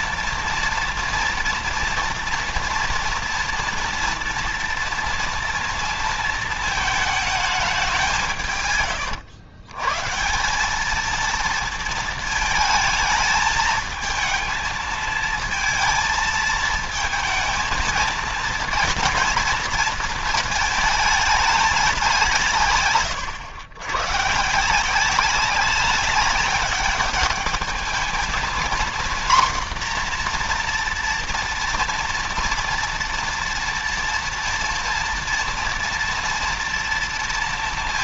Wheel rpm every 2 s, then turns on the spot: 230, 230, 230, 230, 150, 180, 220, 220, 220, 230, 220, 160, 160, 200, 230, 240, 230, 230, 230.
none